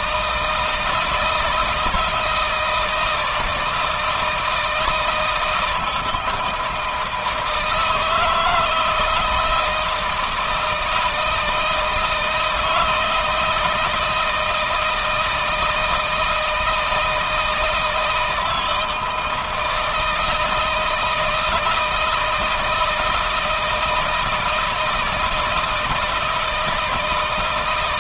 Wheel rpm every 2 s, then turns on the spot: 160, 170, 160, 160, 160, 160, 160, 160, 160, 160, 160, 160, 160, 160.
none